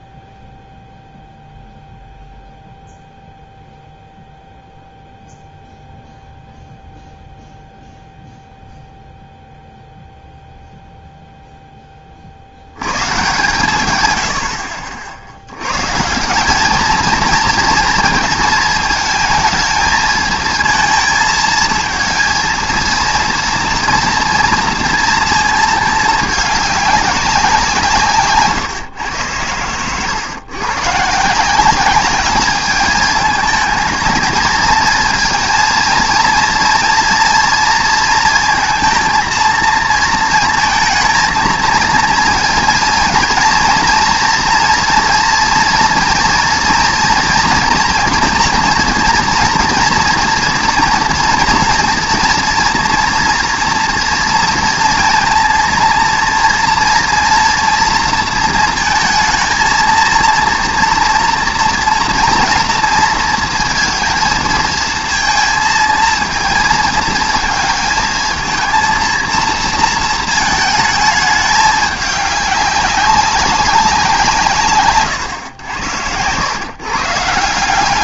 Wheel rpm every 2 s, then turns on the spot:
0, 0, 0, 0, 0, 0, 90, 60, 200, 220, 220, 230, 230, 210, 130, 120, 210, 230, 230, 230, 230, 230, 230, 230, 230, 230, 230, 230, 230, 220, 230, 230, 230, 230, 230, 220, 200, 140, 140.
none